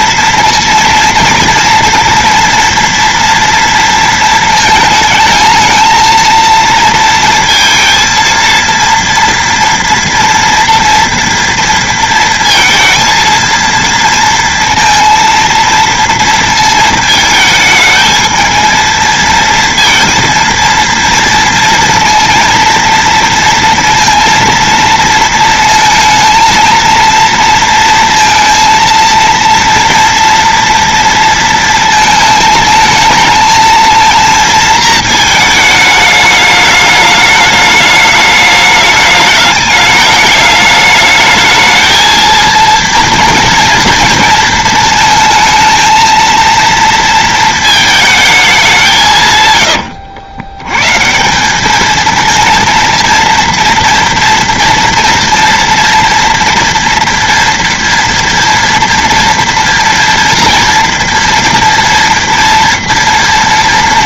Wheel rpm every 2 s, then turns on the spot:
230, 240, 220, 230, 230, 230, 230, 230, 220, 220, 230, 230, 230, 230, 230, 230, 220, 220, 210, 210, 210, 230, 230, 230, 180, 120, 230, 240, 230, 230, 230, 230.
none